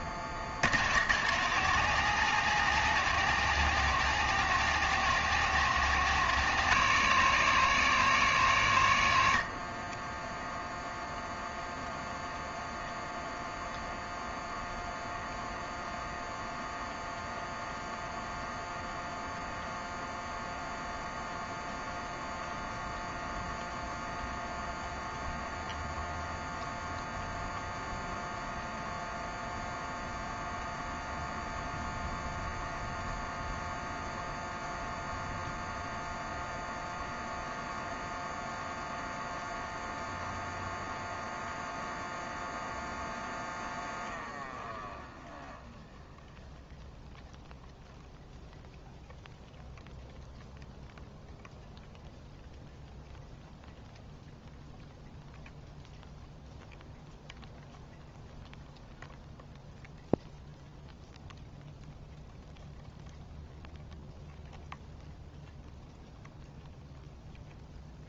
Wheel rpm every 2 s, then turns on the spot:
60, 170, 170, 170, 130, 0, 0, 0, 0, 0, 0, 0, 0, 0, 0, 0, 0, 0, 0, 0, 0, 0, 0, 0, 0, 0, 0, 0, 0, 0, 0, 0, 0, 0.
none